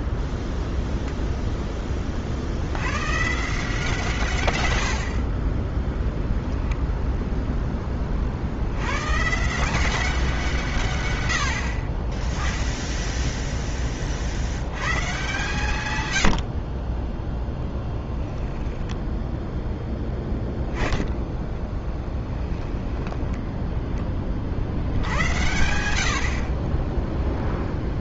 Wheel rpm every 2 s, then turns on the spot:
0, 70, 120, 0, 70, 160, 10, 90, 60, 10, 10, 10, 50, 40.
18-20 22-24